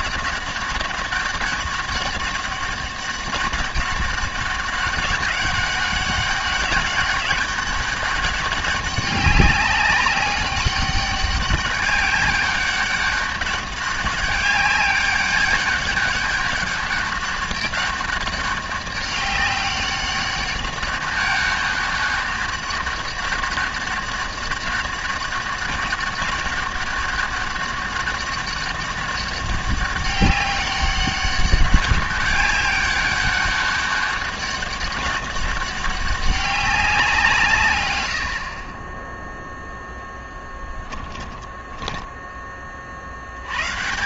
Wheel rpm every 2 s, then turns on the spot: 200, 200, 200, 200, 200, 200, 200, 200, 200, 200, 200, 200, 200, 200, 200, 200, 200, 200, 190, 20, 10, 40.
40-42